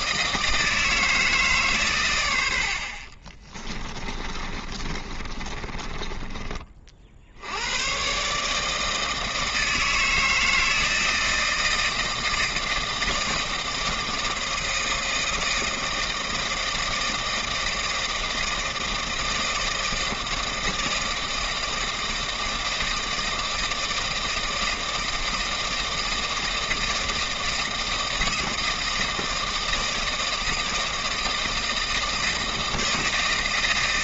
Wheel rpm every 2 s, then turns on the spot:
160, 50, 30, 40, 160, 160, 160, 160, 160, 160, 160, 160, 160, 160, 160, 160, 160.
4-6